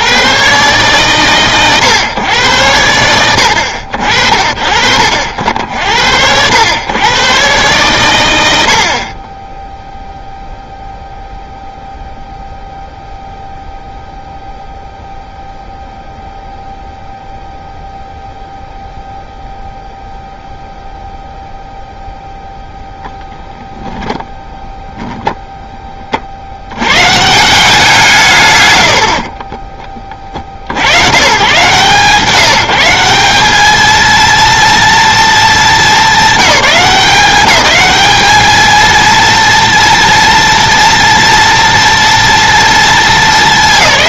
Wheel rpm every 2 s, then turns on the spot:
90, 100, 60, 70, 130, 0, 0, 0, 0, 0, 0, 0, 10, 40, 150, 40, 160, 230, 190, 210, 240, 230.
24-26